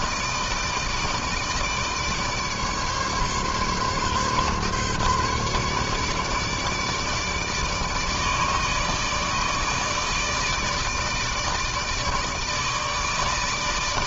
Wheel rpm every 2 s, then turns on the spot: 160, 150, 140, 150, 150, 150, 160.
none